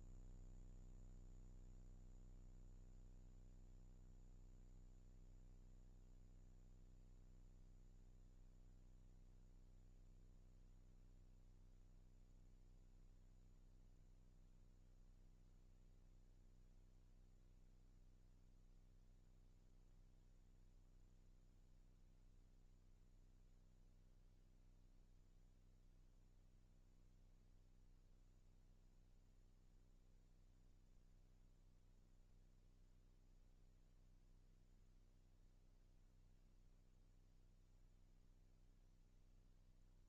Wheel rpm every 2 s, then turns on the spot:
0, 0, 0, 0, 0, 0, 0, 0, 0, 0, 0, 0, 0, 0, 0, 0, 0, 0, 0, 0.
none